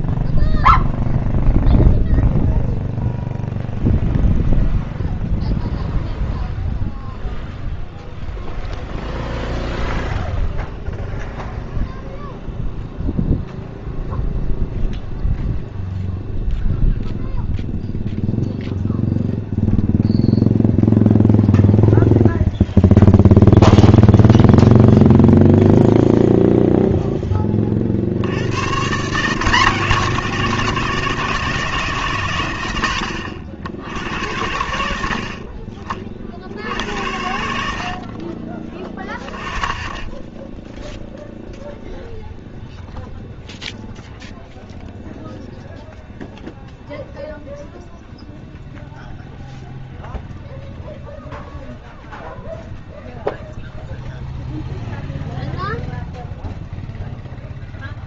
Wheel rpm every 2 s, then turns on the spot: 0, 0, 0, 0, 0, 0, 0, 0, 0, 0, 0, 0, 0, 10, 160, 170, 80, 50, 70, 10, 0, 0, 0, 0, 0, 0, 0, 0, 0.
none